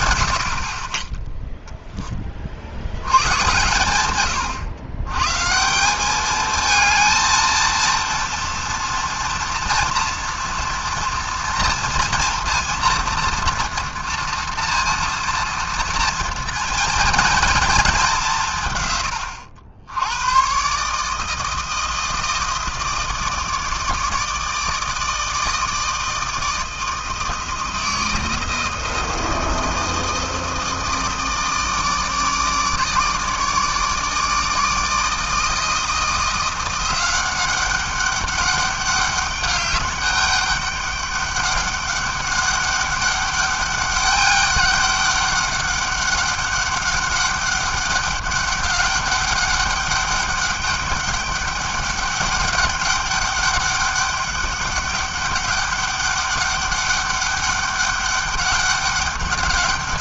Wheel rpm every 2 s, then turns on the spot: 40, 60, 110, 220, 230, 230, 230, 230, 230, 140, 130, 160, 160, 160, 160, 160, 150, 160, 180, 200, 200, 200, 200, 200, 200, 200, 200, 200, 200, 200.
none